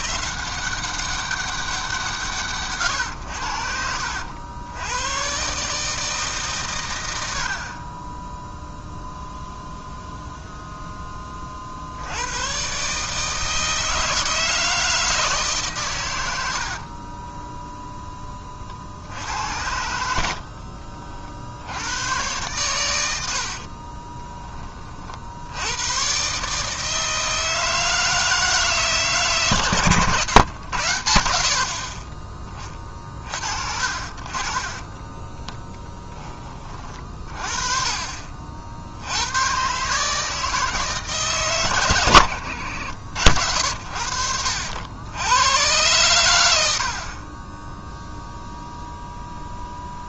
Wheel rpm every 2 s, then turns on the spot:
190, 130, 100, 120, 0, 10, 140, 160, 40, 40, 50, 100, 30, 150, 150, 100, 30, 30, 30, 60, 160, 90, 70, 60, 0.
16-18 20-22 34-36 46-48